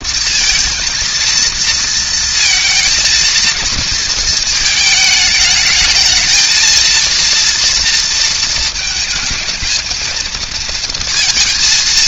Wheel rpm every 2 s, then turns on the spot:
220, 220, 220, 220, 220, 230.
none